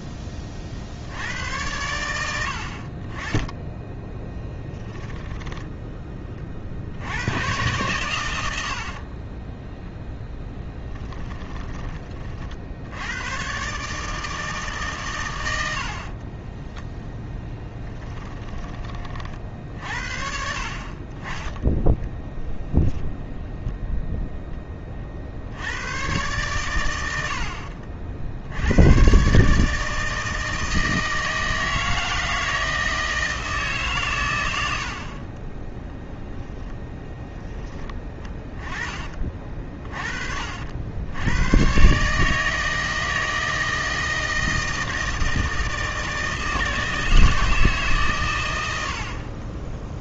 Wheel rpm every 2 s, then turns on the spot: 40, 30, 10, 60, 60, 10, 80, 130, 10, 30, 40, 0, 20, 100, 100, 160, 160, 70, 10, 20, 80, 160, 160, 160, 60.
8-12 36-38